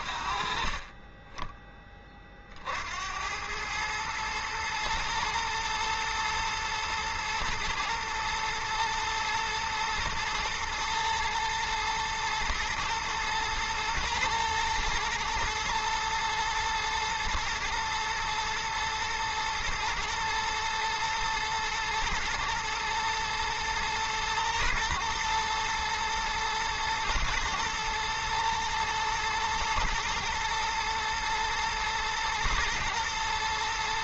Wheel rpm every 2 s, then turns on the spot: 30, 80, 110, 120, 110, 110, 120, 120, 120, 120, 110, 110, 110, 120, 120, 110, 110.
none